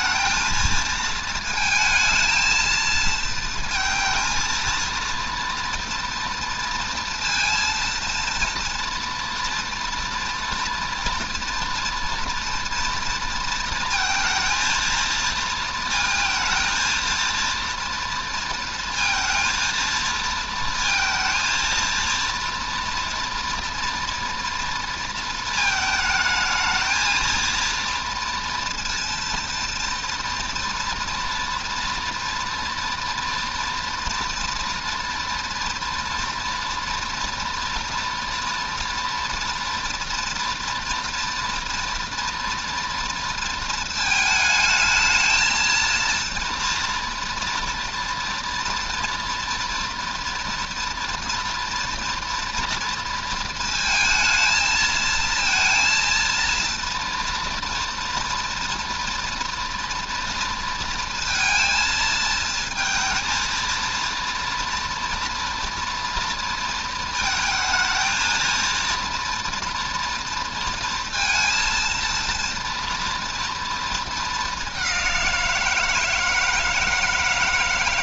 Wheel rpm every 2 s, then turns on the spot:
220, 230, 230, 230, 230, 230, 230, 230, 230, 230, 230, 240, 230, 220, 230, 230, 240, 240, 240, 230, 230, 230, 220, 240, 230, 230, 230, 220, 230, 230, 230, 230, 240, 230, 230, 230, 240, 200, 160.
none